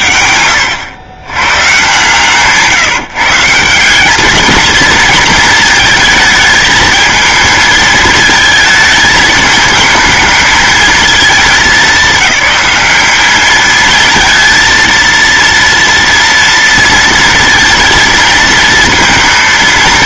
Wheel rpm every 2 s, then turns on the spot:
130, 160, 220, 220, 220, 220, 210, 230, 230, 230.
none